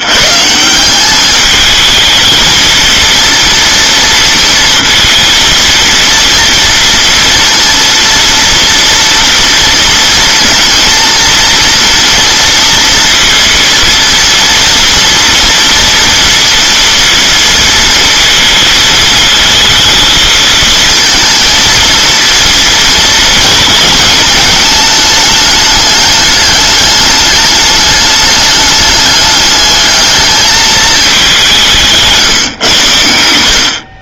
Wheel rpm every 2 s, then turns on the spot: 170, 230, 230, 230, 230, 230, 230, 230, 230, 230, 220, 230, 210, 210, 210, 220, 120.
none